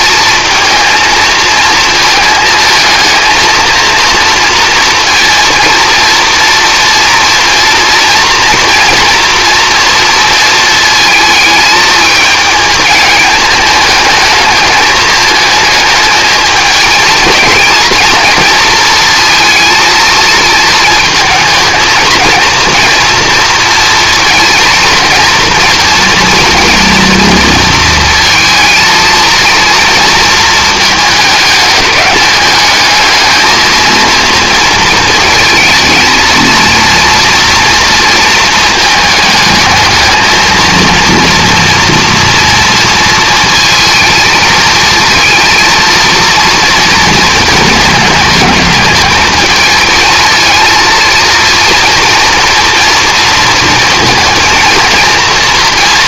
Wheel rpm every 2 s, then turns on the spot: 220, 220, 230, 230, 240, 220, 220, 220, 220, 230, 220, 230, 230, 240, 230, 220, 220, 220, 230, 220, 230, 230, 220, 230, 210, 230, 230, 230.
none